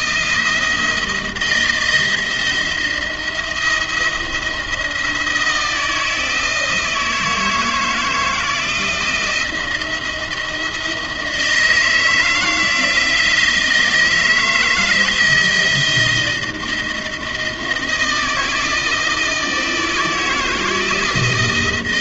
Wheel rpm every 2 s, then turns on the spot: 160, 170, 170, 160, 160, 170, 160, 160, 160, 160, 160.
none